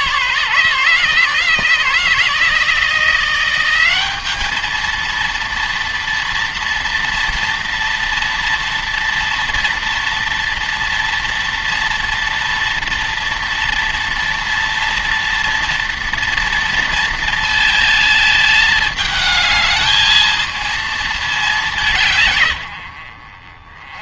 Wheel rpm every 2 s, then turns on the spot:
150, 160, 220, 230, 230, 230, 240, 230, 230, 220, 220, 90.
none